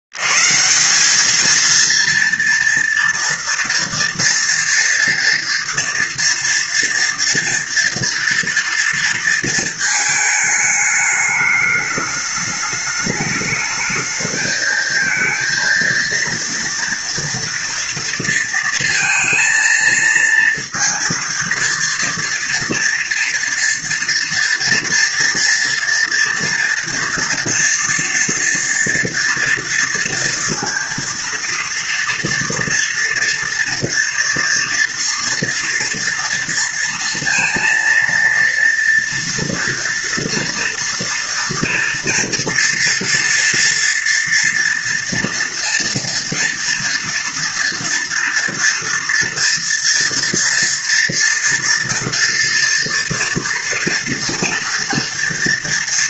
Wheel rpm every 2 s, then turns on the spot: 60, 230, 230, 230, 230, 220, 210, 220, 230, 230, 230, 230, 230, 230, 230, 230, 230, 240, 230, 230, 230, 230, 230, 230, 230, 230, 230, 230.
none